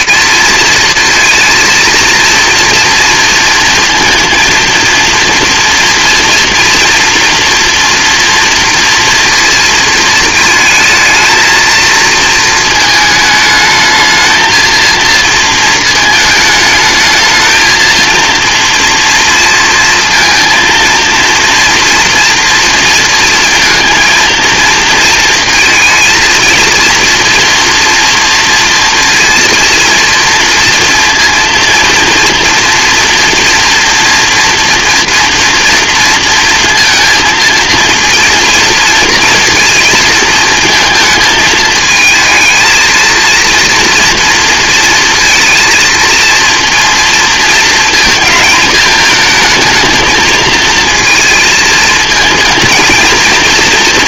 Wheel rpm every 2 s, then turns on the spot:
230, 230, 230, 230, 230, 220, 220, 230, 220, 230, 230, 230, 230, 230, 230, 230, 230, 230, 230, 230, 230, 220, 230, 230, 220, 230, 230.
none